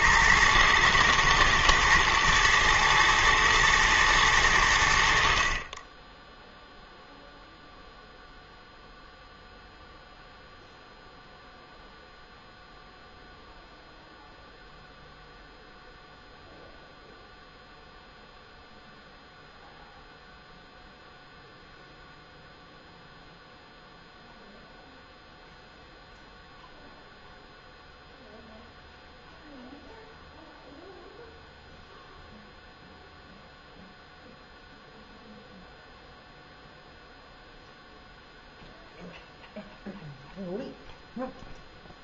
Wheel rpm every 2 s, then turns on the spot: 110, 110, 50, 0, 0, 0, 0, 0, 0, 0, 0, 0, 0, 0, 0, 0, 0, 0, 0, 0, 0.
none